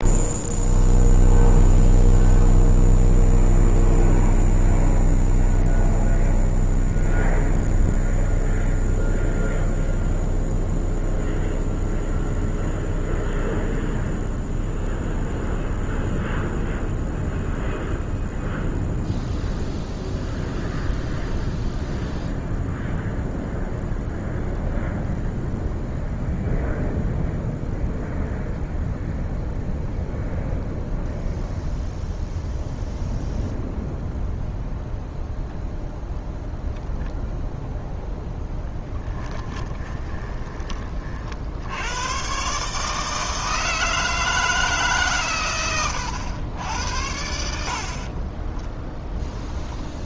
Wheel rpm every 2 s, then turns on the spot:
0, 0, 0, 0, 0, 0, 0, 0, 0, 0, 0, 0, 0, 0, 0, 0, 0, 0, 0, 10, 20, 140, 150, 80, 10.
38-40 48-50